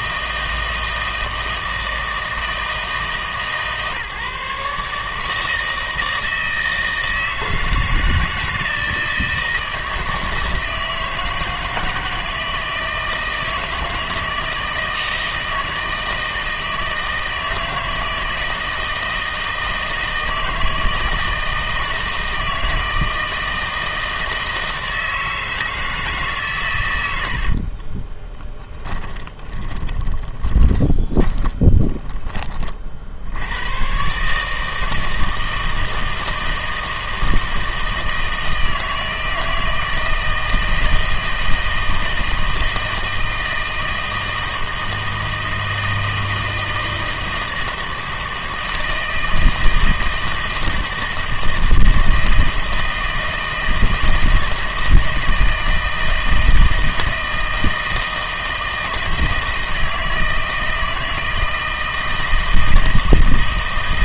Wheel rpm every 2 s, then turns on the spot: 160, 160, 140, 160, 160, 160, 160, 160, 160, 160, 160, 160, 160, 120, 10, 20, 40, 160, 160, 160, 160, 160, 160, 160, 160, 160, 160, 160, 160, 160, 160, 160.
28-32